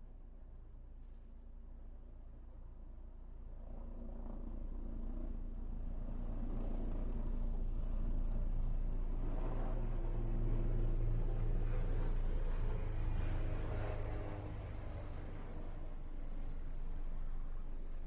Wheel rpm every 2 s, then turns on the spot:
0, 0, 0, 0, 0, 0, 0, 0, 0.
none